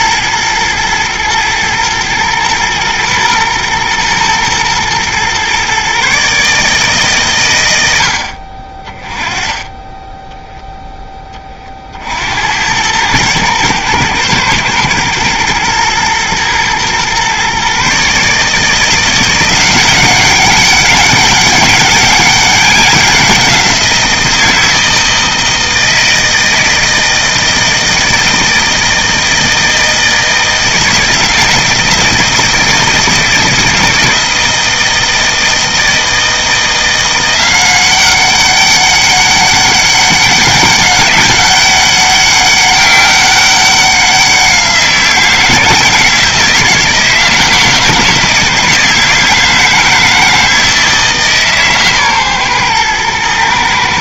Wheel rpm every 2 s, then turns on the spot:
110, 120, 120, 150, 30, 0, 100, 120, 120, 160, 200, 190, 160, 160, 160, 160, 160, 160, 170, 200, 200, 200, 170, 160, 160, 160, 120.
none